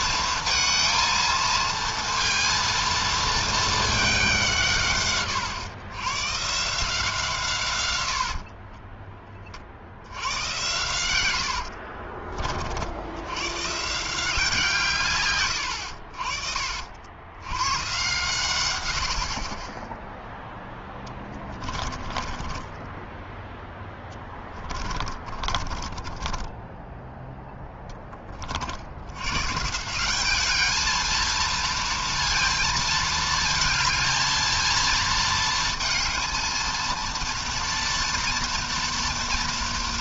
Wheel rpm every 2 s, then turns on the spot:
230, 230, 170, 140, 50, 90, 40, 160, 60, 110, 0, 20, 10, 20, 40, 210, 230, 220, 230, 240.
8-10 22-28